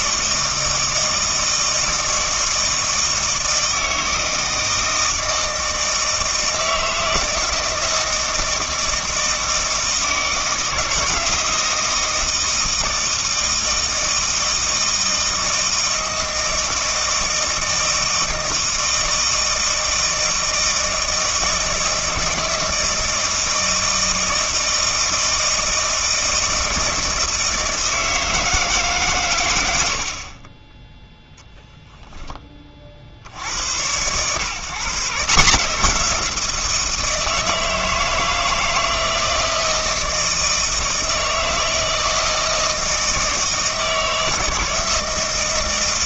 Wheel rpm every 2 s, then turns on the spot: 160, 160, 160, 160, 160, 160, 160, 160, 160, 160, 160, 160, 160, 160, 150, 20, 40, 140, 170, 160, 160, 160, 160.
none